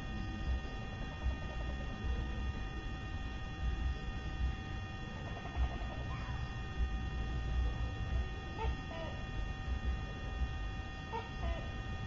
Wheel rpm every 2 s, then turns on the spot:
0, 0, 0, 0, 0, 0.
none